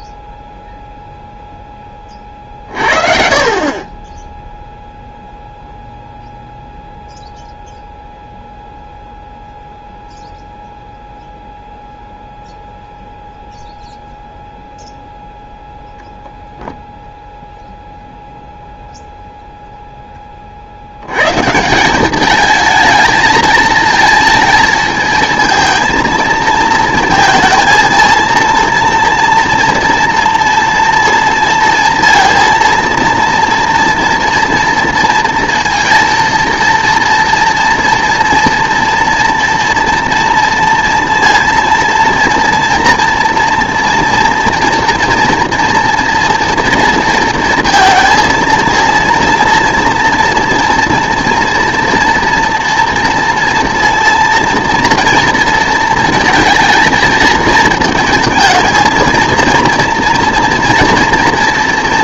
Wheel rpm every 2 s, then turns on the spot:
0, 40, 0, 0, 0, 0, 0, 0, 0, 0, 50, 220, 220, 230, 230, 230, 230, 230, 230, 230, 230, 230, 230, 240, 230, 230, 230, 230, 230, 220, 230.
none